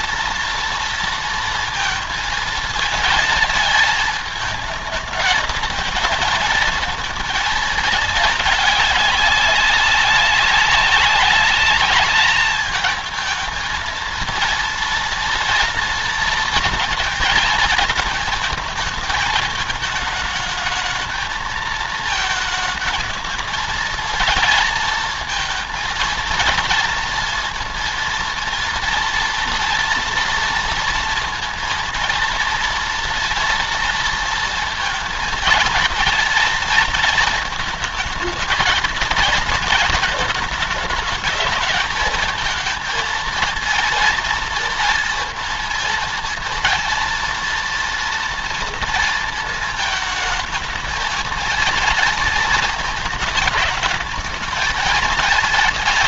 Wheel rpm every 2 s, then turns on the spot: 230, 230, 220, 230, 220, 200, 220, 230, 230, 220, 220, 220, 220, 230, 230, 230, 230, 230, 230, 220, 220, 220, 230, 230, 230, 220, 230, 210.
none